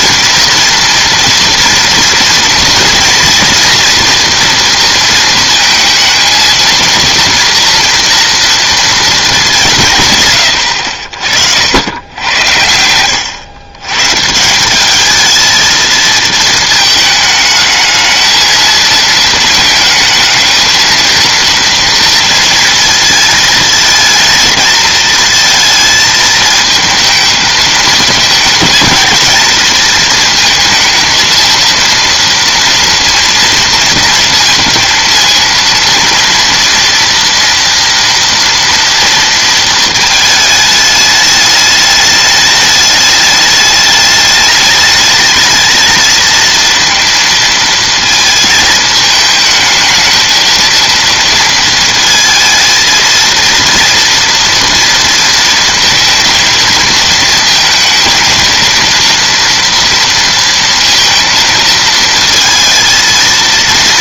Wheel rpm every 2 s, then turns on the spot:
230, 230, 230, 230, 230, 100, 80, 180, 220, 220, 220, 230, 220, 220, 220, 220, 230, 230, 230, 230, 220, 210, 210, 230, 220, 230, 230, 230, 230, 230, 230, 230.
none